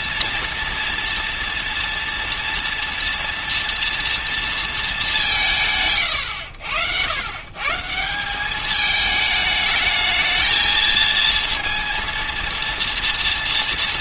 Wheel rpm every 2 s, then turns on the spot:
230, 230, 210, 90, 210, 220, 230.
none